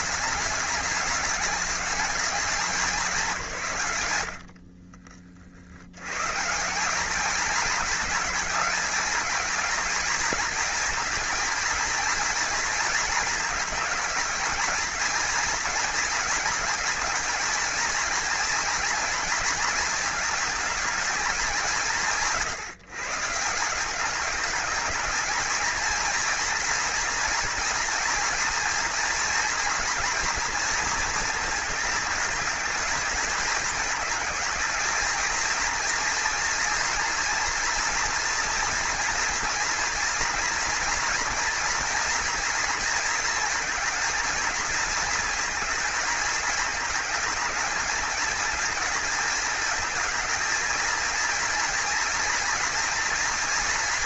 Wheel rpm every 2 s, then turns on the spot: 210, 200, 60, 190, 220, 230, 230, 230, 220, 230, 220, 150, 230, 230, 230, 230, 220, 220, 230, 230, 240, 230, 220, 220, 220, 220, 230.
4-6